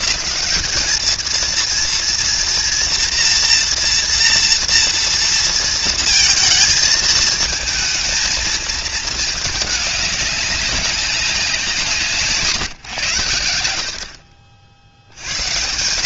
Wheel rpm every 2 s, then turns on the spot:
200, 230, 230, 220, 220, 200, 140, 10.
none